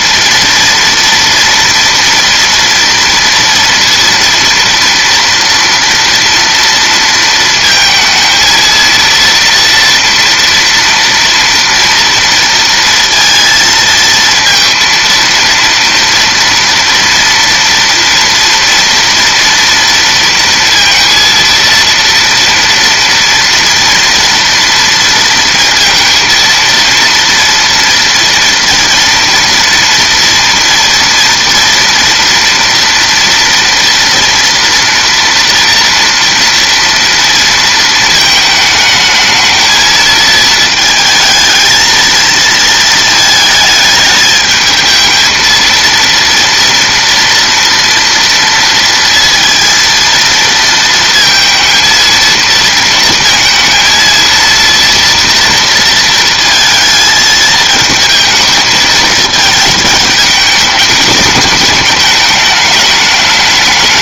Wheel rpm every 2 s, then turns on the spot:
240, 230, 230, 230, 230, 230, 230, 230, 230, 230, 230, 230, 230, 230, 230, 240, 230, 230, 230, 220, 220, 220, 220, 230, 230, 230, 230, 230, 220, 220, 210, 210.
none